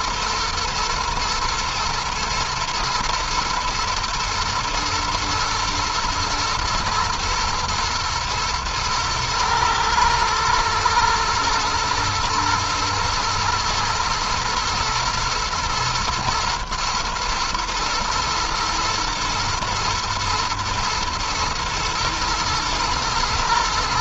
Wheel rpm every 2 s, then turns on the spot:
110, 110, 110, 110, 110, 120, 120, 110, 120, 120, 110, 120.
none